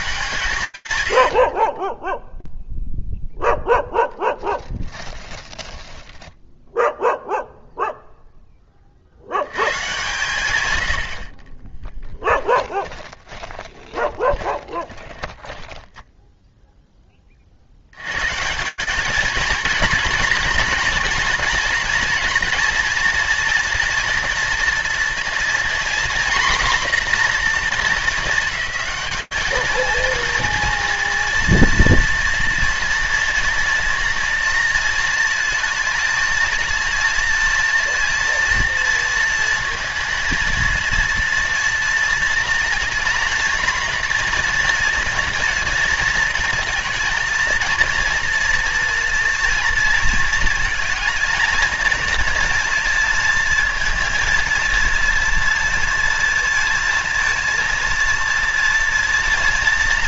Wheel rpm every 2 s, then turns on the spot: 120, 0, 20, 0, 20, 90, 20, 20, 20, 220, 240, 240, 240, 250, 220, 240, 230, 230, 230, 230, 230, 230, 230, 230, 230, 230, 230, 230, 230, 230.
4-6 12-16